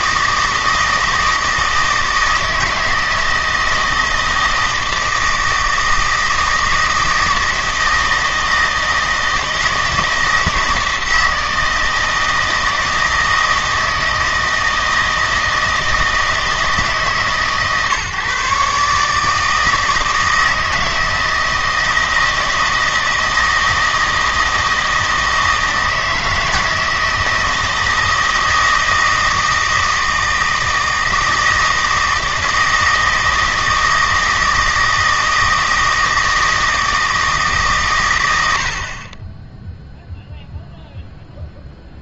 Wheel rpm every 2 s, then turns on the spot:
160, 160, 160, 160, 160, 160, 160, 160, 150, 140, 160, 160, 160, 160, 160, 160, 160, 160, 160, 70, 0.
none